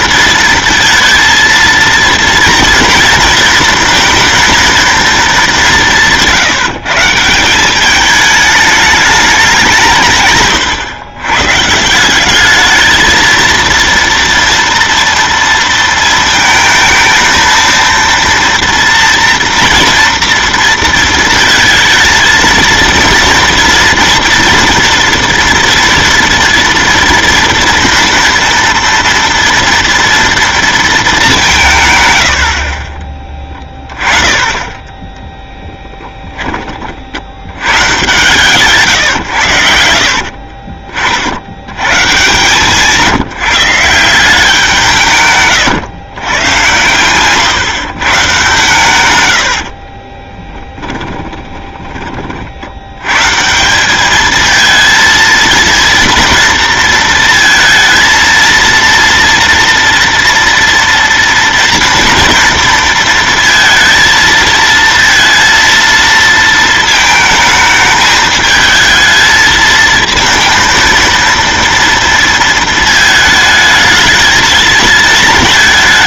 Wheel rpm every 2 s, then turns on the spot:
230, 230, 230, 160, 210, 120, 210, 230, 220, 230, 230, 230, 240, 230, 230, 230, 50, 20, 30, 140, 50, 150, 160, 120, 130, 10, 70, 220, 230, 230, 240, 230, 230, 220, 220, 230, 230, 220.
40-42 50-52